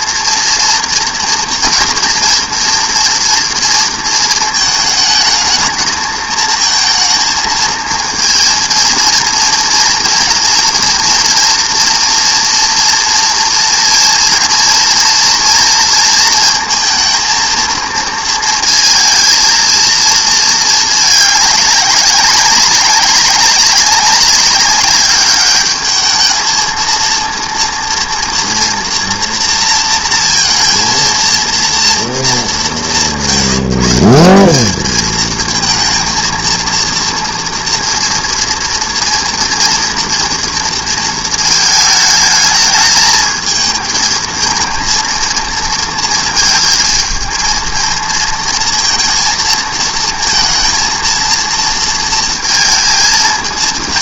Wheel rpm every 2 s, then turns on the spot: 230, 230, 220, 220, 230, 230, 230, 240, 230, 230, 220, 190, 200, 220, 230, 230, 190, 200, 230, 230, 230, 220, 230, 220, 230, 230, 230.
none